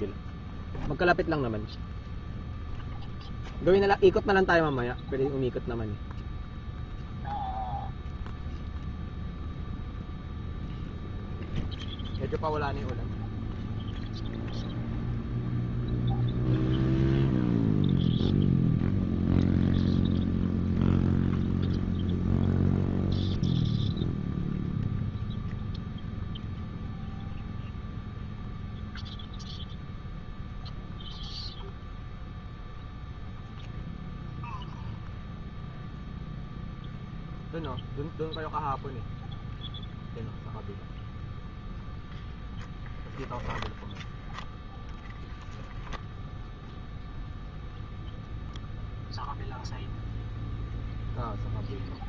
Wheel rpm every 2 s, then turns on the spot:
0, 0, 0, 0, 0, 0, 0, 0, 0, 0, 0, 0, 0, 0, 0, 0, 0, 0, 0, 0, 0, 0, 0, 0, 0, 0.
none